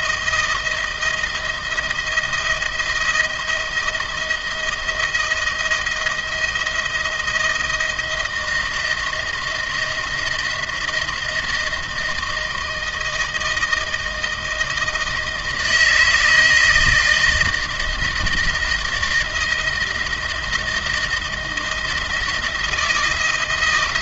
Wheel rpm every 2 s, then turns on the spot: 170, 170, 160, 160, 160, 170, 160, 160, 160, 160, 170, 160.
none